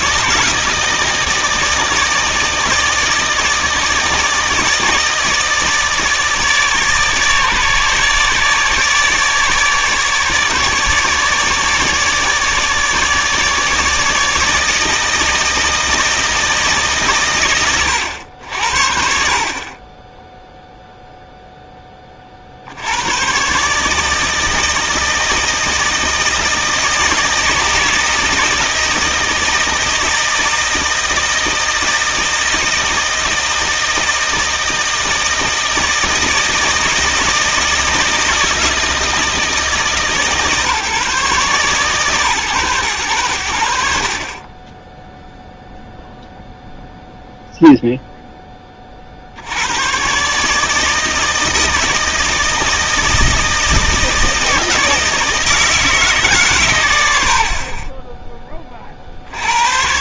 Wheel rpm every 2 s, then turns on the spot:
160, 160, 160, 150, 150, 150, 150, 160, 160, 70, 0, 60, 160, 160, 160, 160, 160, 160, 160, 160, 150, 120, 20, 0, 20, 150, 160, 160, 140, 20.
none